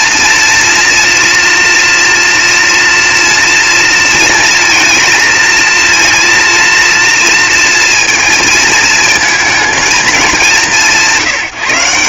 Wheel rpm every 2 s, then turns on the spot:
230, 230, 230, 230, 220, 140.
none